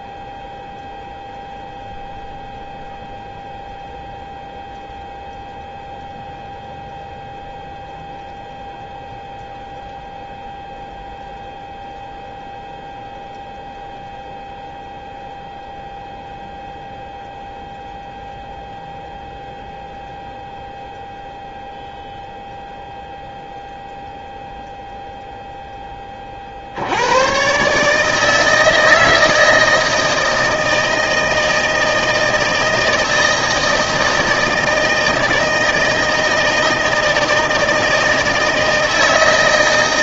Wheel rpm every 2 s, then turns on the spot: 0, 0, 0, 0, 0, 0, 0, 0, 0, 0, 0, 0, 0, 60, 160, 160, 160, 160, 160, 160.
none